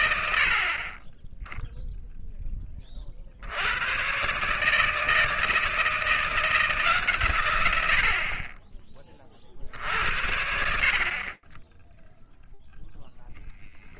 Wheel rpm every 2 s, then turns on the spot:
10, 60, 160, 130, 40, 30, 0.
none